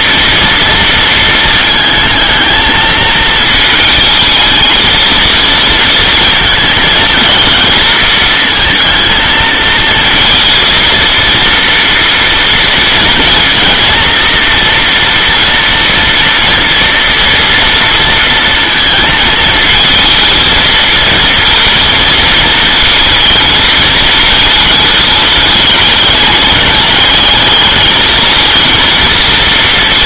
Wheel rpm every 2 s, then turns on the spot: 230, 220, 220, 230, 230, 230, 230, 230, 230, 230, 230, 220, 220, 220, 230.
none